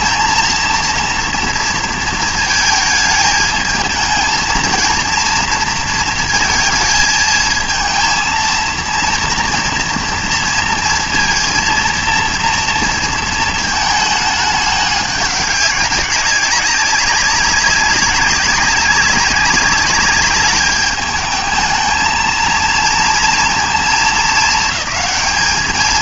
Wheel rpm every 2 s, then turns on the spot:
230, 220, 220, 230, 230, 230, 230, 210, 200, 200, 210, 230, 220.
none